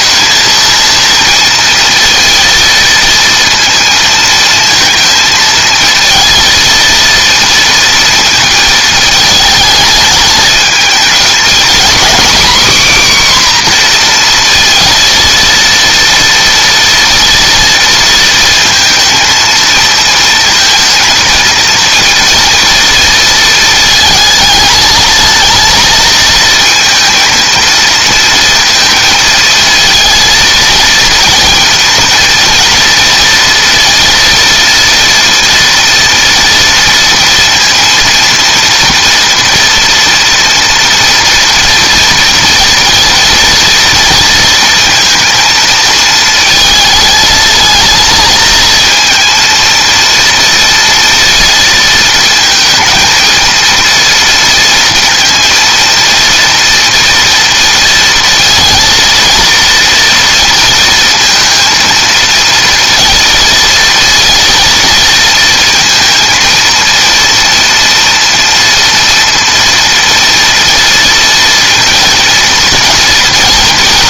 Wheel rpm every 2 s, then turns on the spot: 220, 230, 230, 230, 220, 210, 260, 230, 230, 230, 220, 230, 220, 220, 230, 230, 230, 230, 230, 230, 240, 230, 230, 230, 230, 230, 230, 230, 230, 230, 230, 230, 230, 230, 230, 230, 230.
none